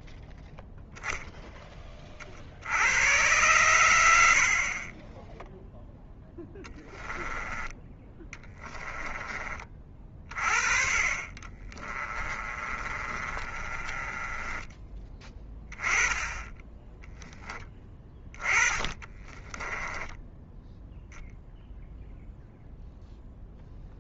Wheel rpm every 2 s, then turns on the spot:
0, 80, 40, 10, 20, 30, 30, 20, 10, 20, 0, 0.
6-8 10-16 18-20